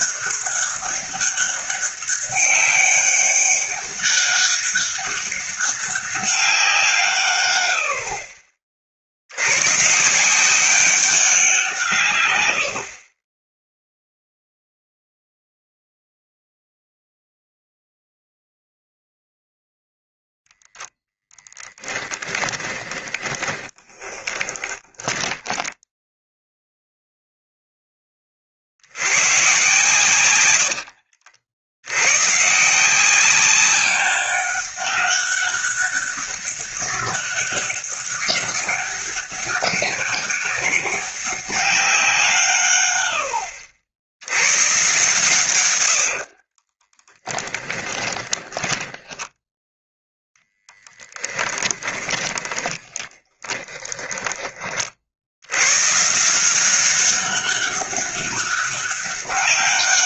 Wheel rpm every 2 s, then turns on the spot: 200, 200, 200, 160, 50, 190, 60, 0, 0, 0, 0, 20, 20, 0, 60, 70, 170, 200, 200, 200, 200, 120, 130, 20, 10, 10, 20, 40, 190, 200.
22-26 30-32 46-50 52-54